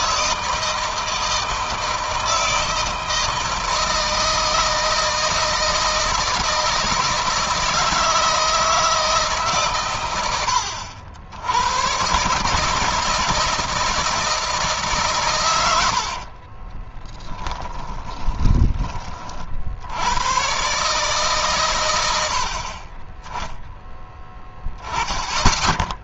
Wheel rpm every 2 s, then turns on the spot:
160, 160, 160, 160, 160, 80, 160, 140, 20, 30, 140, 20, 10.
16-18